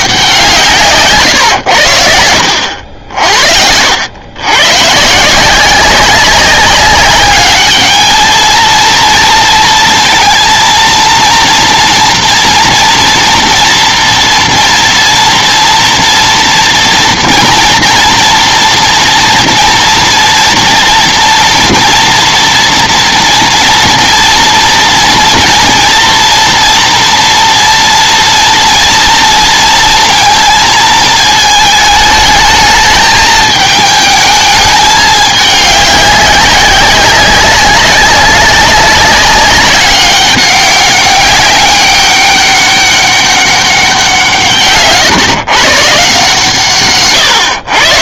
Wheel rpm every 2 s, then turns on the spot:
170, 80, 120, 190, 220, 230, 230, 230, 240, 230, 240, 230, 240, 230, 230, 230, 220, 210, 190, 200, 200, 200, 150, 140.
none